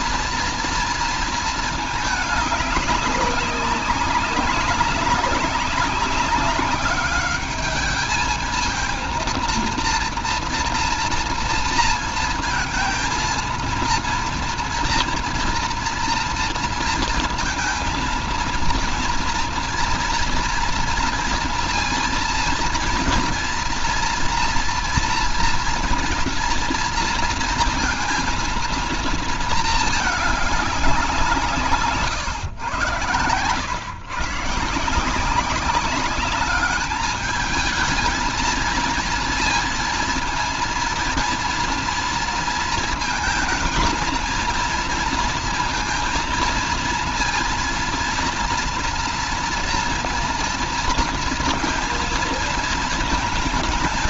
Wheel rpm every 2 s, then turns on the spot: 230, 200, 200, 210, 230, 230, 230, 230, 230, 240, 230, 230, 230, 240, 230, 180, 110, 180, 210, 230, 230, 230, 230, 230, 230, 230, 220.
none